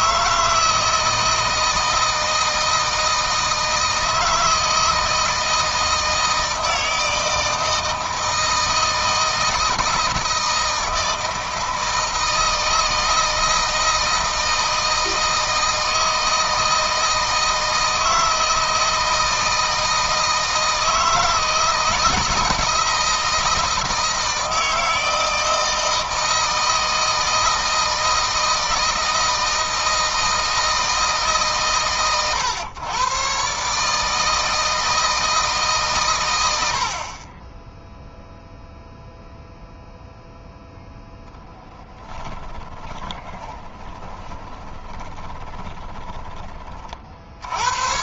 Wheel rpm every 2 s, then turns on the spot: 160, 160, 160, 160, 160, 160, 160, 160, 160, 160, 160, 160, 160, 160, 160, 160, 120, 160, 70, 0, 0, 20, 10, 40.
42-46